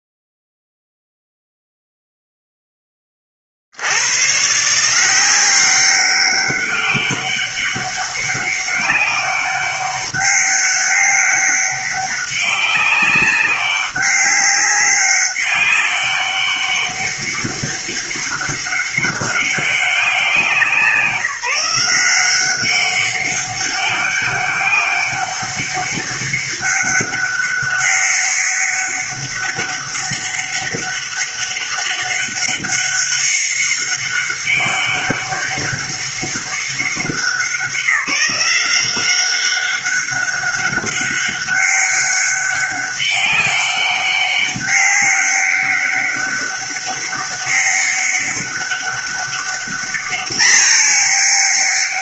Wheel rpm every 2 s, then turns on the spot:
0, 10, 140, 200, 200, 200, 200, 200, 200, 200, 180, 190, 200, 200, 200, 200, 200, 200, 200, 190, 200, 200, 200, 200, 200, 210.
none